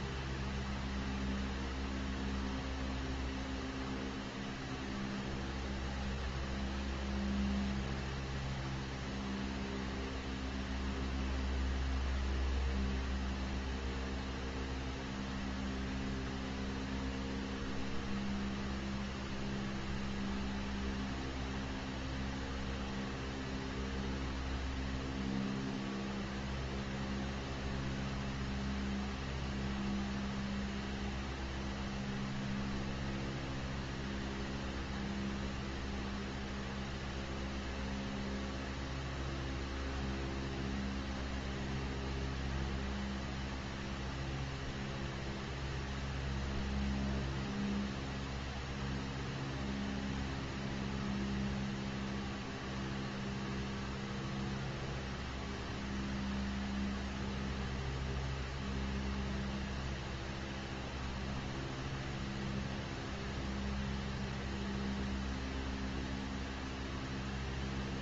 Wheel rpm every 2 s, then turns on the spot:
0, 0, 0, 0, 0, 0, 0, 0, 0, 0, 0, 0, 0, 0, 0, 0, 0, 0, 0, 0, 0, 0, 0, 0, 0, 0, 0, 0, 0, 0, 0, 0, 0, 0.
none